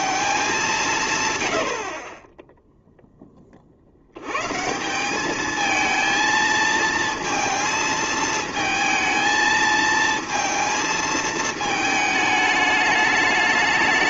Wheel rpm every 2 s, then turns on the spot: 190, 0, 140, 230, 220, 230, 210.
none